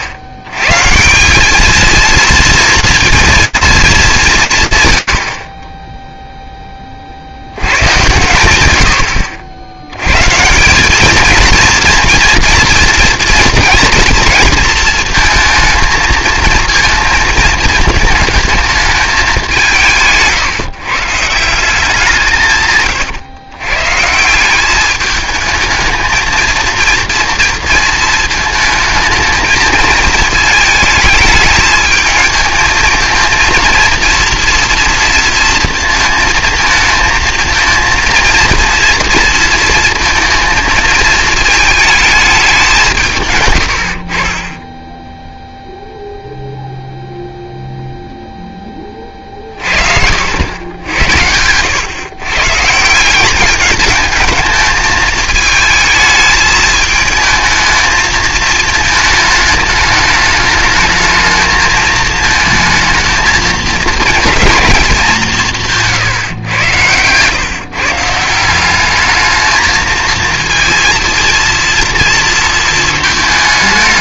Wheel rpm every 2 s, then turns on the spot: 90, 230, 80, 30, 90, 200, 230, 230, 230, 210, 150, 140, 210, 230, 220, 220, 230, 230, 230, 230, 220, 160, 10, 0, 30, 80, 170, 220, 220, 220, 220, 220, 200, 120, 210, 230, 220.
none